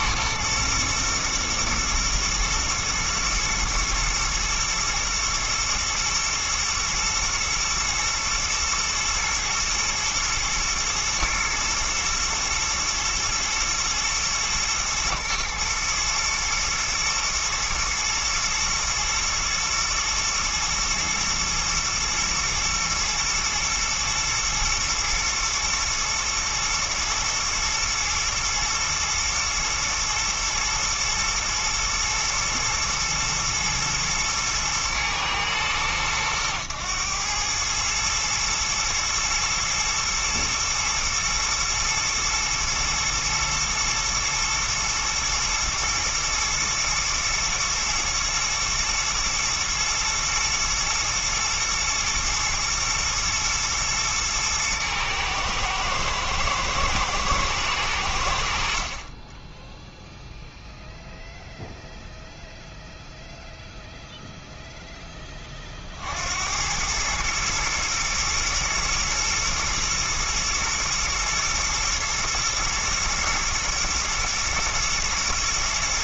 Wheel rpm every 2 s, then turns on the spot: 120, 120, 120, 120, 120, 110, 120, 120, 120, 110, 110, 120, 110, 110, 110, 120, 110, 110, 110, 110, 110, 110, 110, 110, 110, 110, 120, 120, 110, 50, 0, 0, 0, 90, 120, 120, 120, 120.
none